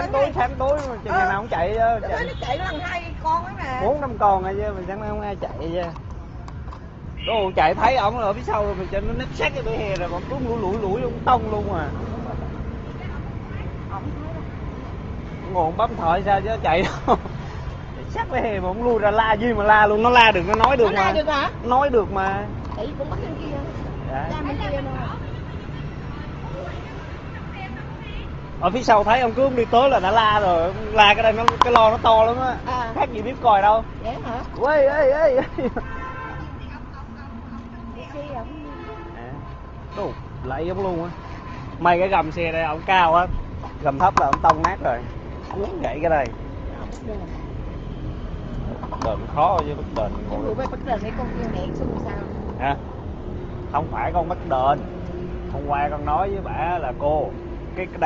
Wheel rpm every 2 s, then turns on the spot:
0, 0, 0, 0, 0, 0, 0, 0, 0, 0, 0, 0, 0, 0, 0, 0, 0, 0, 0, 0, 0, 0, 0, 0, 0, 0, 0, 0, 0.
none